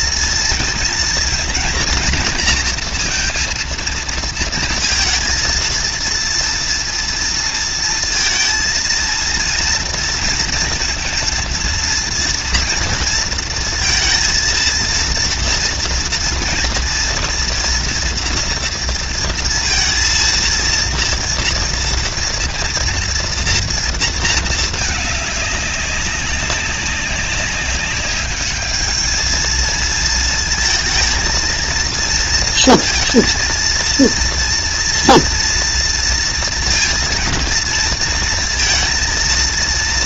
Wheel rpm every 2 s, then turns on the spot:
230, 230, 220, 230, 230, 230, 230, 230, 230, 230, 230, 230, 210, 200, 220, 220, 230, 230, 230, 230.
none